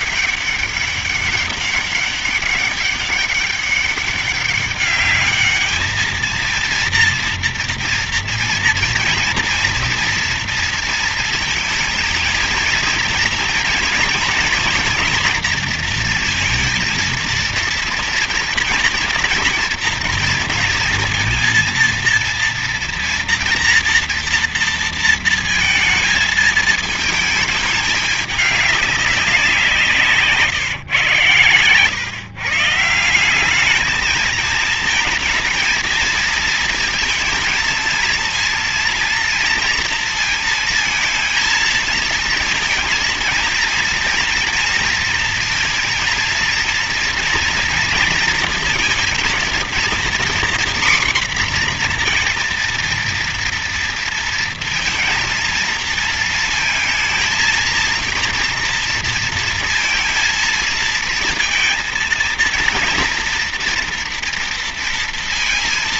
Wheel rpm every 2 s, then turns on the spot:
200, 200, 200, 230, 230, 230, 230, 230, 230, 230, 230, 230, 230, 220, 200, 140, 150, 220, 230, 240, 230, 230, 230, 230, 230, 250, 230, 230, 230, 230, 230, 230, 230.
none